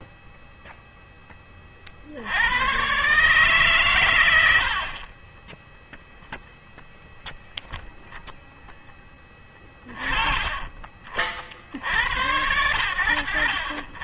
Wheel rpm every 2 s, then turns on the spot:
0, 130, 30, 0, 10, 30, 80.
4-6